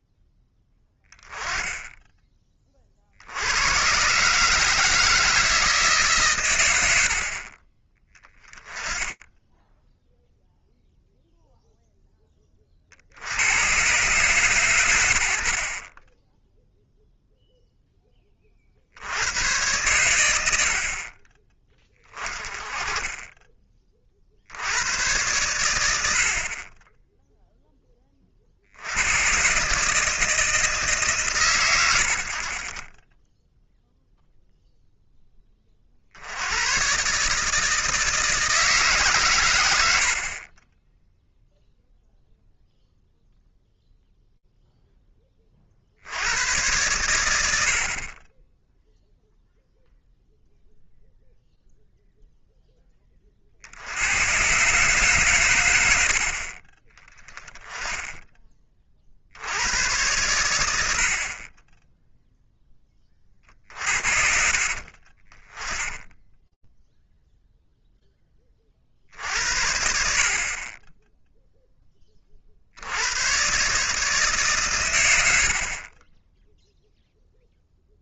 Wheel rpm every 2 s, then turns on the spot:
10, 30, 150, 80, 20, 0, 40, 110, 0, 50, 60, 20, 80, 30, 60, 150, 30, 0, 100, 150, 30, 0, 0, 100, 10, 0, 10, 130, 40, 20, 90, 10, 50, 0, 40, 30, 60, 130, 0.
none